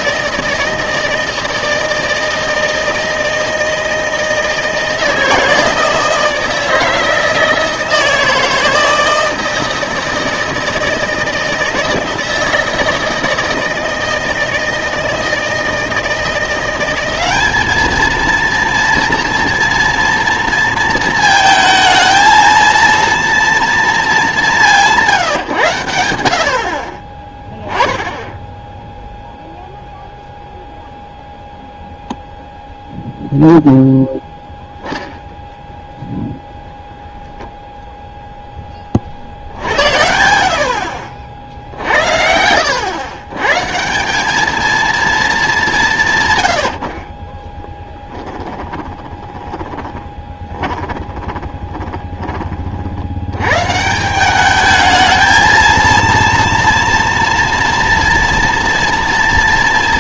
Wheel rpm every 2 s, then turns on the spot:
160, 160, 160, 160, 160, 160, 160, 160, 180, 230, 230, 230, 180, 40, 0, 0, 0, 0, 0, 20, 70, 90, 220, 90, 10, 20, 30, 210, 230, 230.
48-52